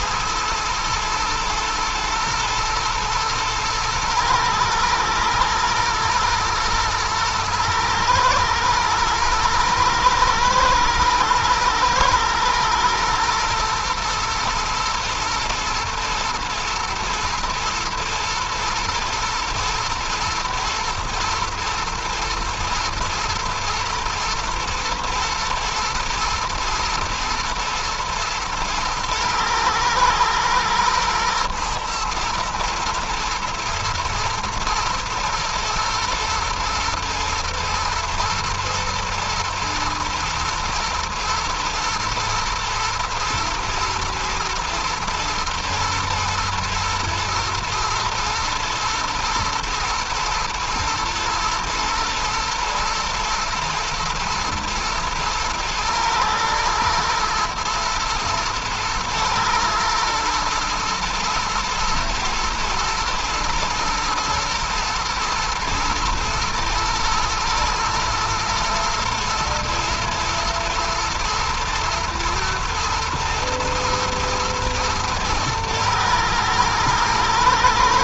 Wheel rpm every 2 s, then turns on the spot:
110, 120, 110, 110, 110, 110, 110, 110, 120, 120, 120, 110, 110, 120, 120, 110, 110, 120, 110, 110, 110, 110, 110, 110, 110, 120, 110, 110, 110, 110, 110, 110, 120, 110, 120, 110, 110, 120, 110.
none